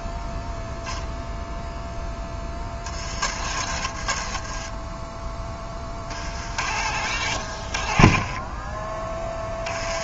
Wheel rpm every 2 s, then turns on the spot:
0, 60, 20, 70, 20.
4-6